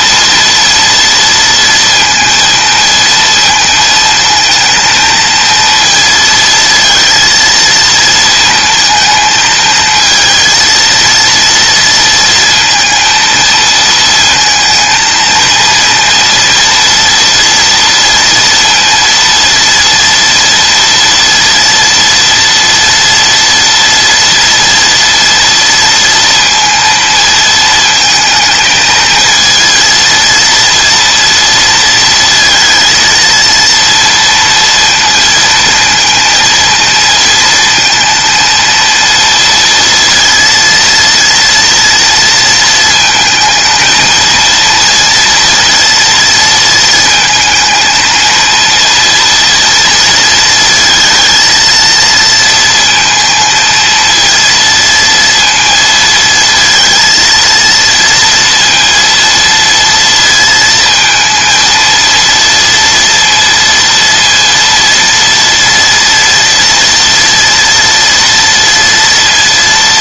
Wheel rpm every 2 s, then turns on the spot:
230, 230, 230, 230, 220, 230, 230, 220, 230, 230, 230, 230, 230, 230, 220, 230, 220, 230, 230, 230, 230, 230, 230, 220, 230, 230, 230, 230, 230, 230, 230, 230, 230, 230, 230.
none